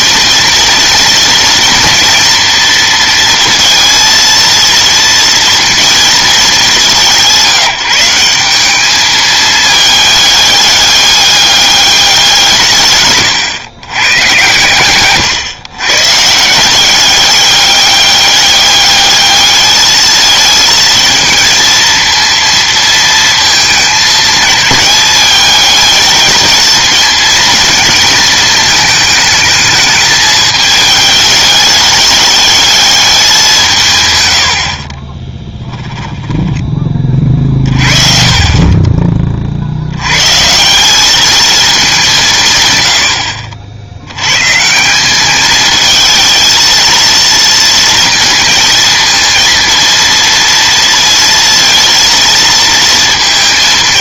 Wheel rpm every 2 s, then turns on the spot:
230, 230, 230, 190, 200, 200, 140, 120, 170, 200, 230, 230, 210, 220, 220, 210, 210, 50, 20, 30, 160, 120, 150, 230, 230, 230, 230.
34-36